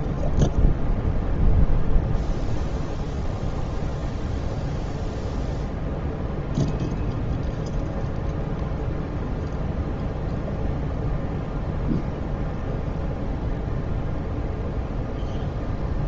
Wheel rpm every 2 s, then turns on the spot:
70, 0, 0, 0, 0, 0, 0, 0.
none